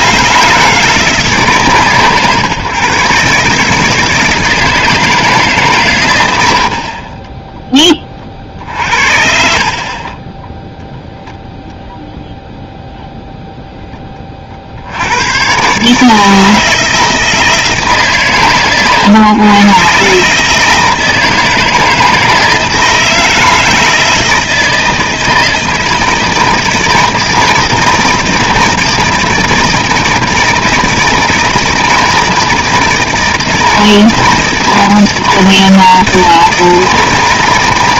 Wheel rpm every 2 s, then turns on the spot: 160, 130, 160, 70, 50, 10, 0, 50, 160, 130, 150, 160, 160, 160, 160, 160, 160, 160, 160.
8-12